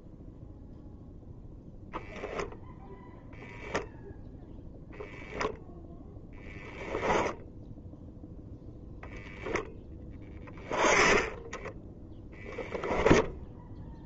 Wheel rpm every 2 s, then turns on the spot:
0, 0, 10, 10, 0, 10, 0.
6-8 10-12